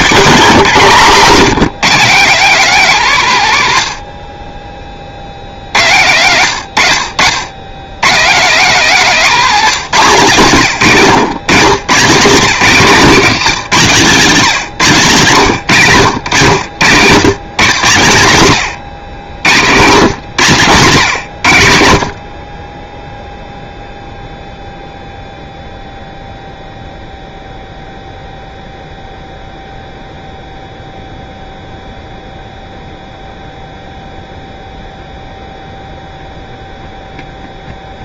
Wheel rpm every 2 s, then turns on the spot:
220, 200, 30, 100, 180, 140, 180, 170, 110, 130, 130, 40, 0, 0, 0, 0, 0, 0, 0.
none